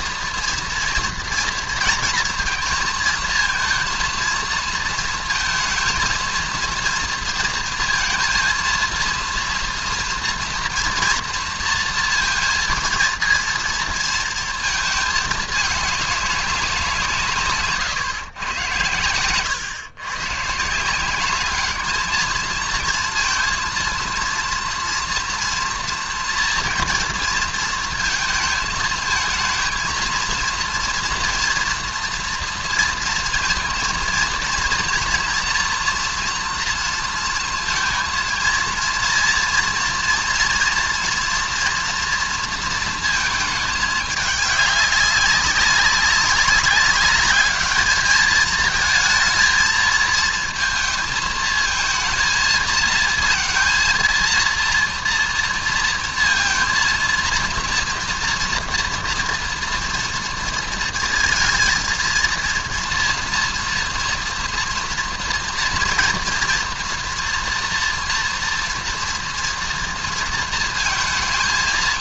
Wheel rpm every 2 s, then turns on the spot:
230, 230, 230, 230, 230, 230, 230, 220, 180, 110, 170, 230, 230, 230, 220, 230, 230, 230, 230, 230, 230, 230, 200, 200, 220, 220, 230, 230, 230, 230, 230, 230, 240, 230, 230, 230.
none